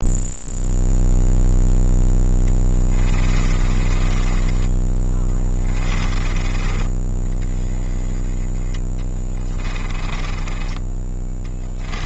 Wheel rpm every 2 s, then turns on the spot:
0, 20, 20, 20, 10, 20.
2-6 10-12